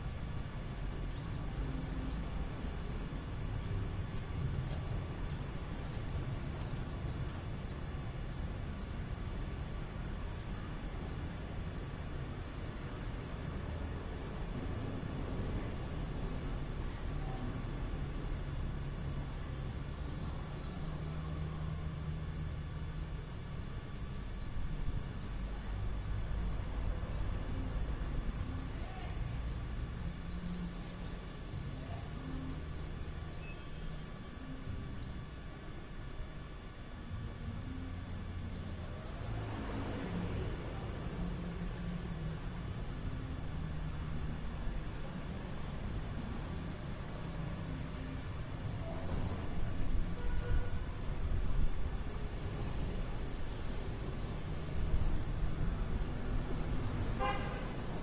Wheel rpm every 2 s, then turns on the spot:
0, 0, 0, 0, 0, 0, 0, 0, 0, 0, 0, 0, 0, 0, 0, 0, 0, 0, 0, 0, 0, 0, 0, 0, 0, 0, 0, 0, 0.
none